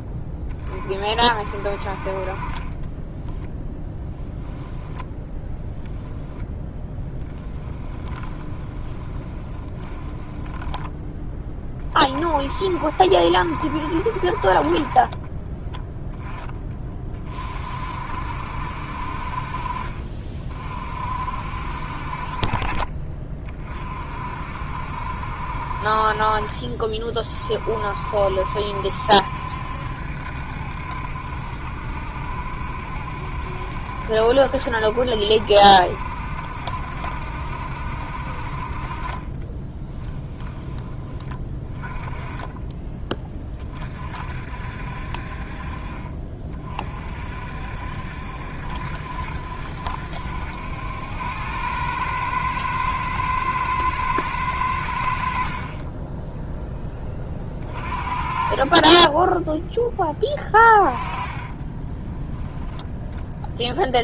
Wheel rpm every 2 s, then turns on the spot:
40, 20, 10, 10, 20, 10, 50, 40, 20, 60, 40, 40, 60, 40, 60, 70, 70, 70, 70, 50, 10, 20, 50, 40, 70, 80, 110, 90, 10, 30, 20, 0.
2-4 6-12 60-62